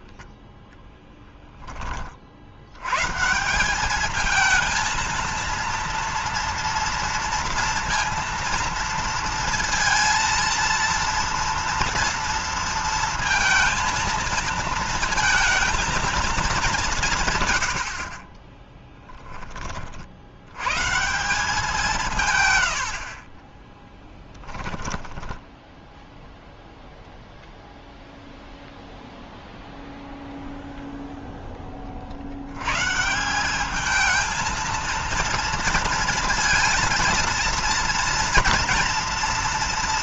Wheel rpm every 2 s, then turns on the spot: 0, 90, 230, 230, 230, 230, 230, 230, 200, 30, 120, 100, 10, 0, 0, 0, 110, 230, 230, 230.
18-20 22-26